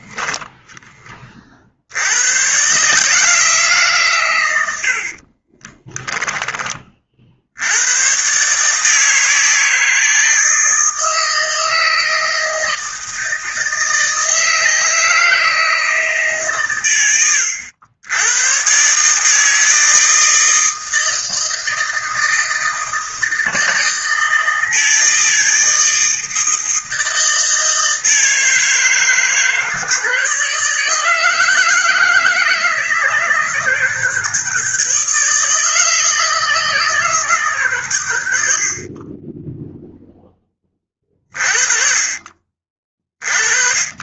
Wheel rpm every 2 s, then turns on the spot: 10, 150, 70, 30, 150, 160, 160, 160, 130, 130, 160, 160, 160, 160, 160, 160, 160, 160, 160, 50, 20, 30.
none